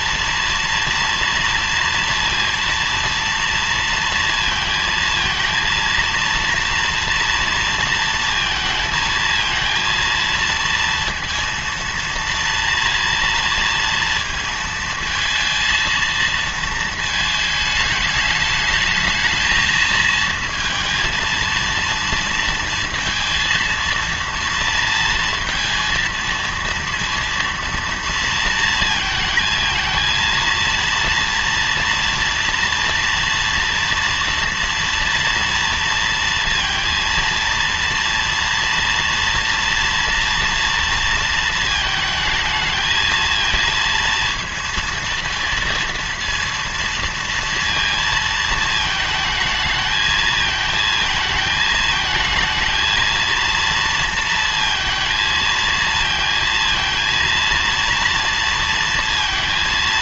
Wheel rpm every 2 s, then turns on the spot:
230, 230, 230, 230, 220, 230, 230, 230, 230, 210, 230, 230, 230, 230, 230, 230, 240, 230, 230, 240, 230, 220, 230, 230, 220, 220, 220, 230, 230, 230.
none